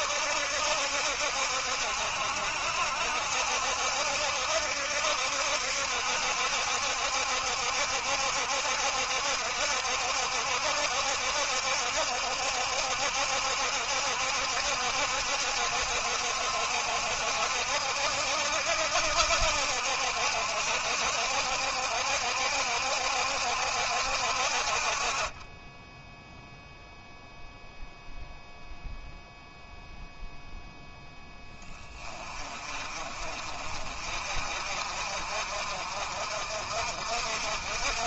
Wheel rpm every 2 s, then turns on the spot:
70, 70, 70, 70, 70, 70, 70, 70, 70, 70, 70, 70, 30, 0, 0, 10, 40, 50, 50.
none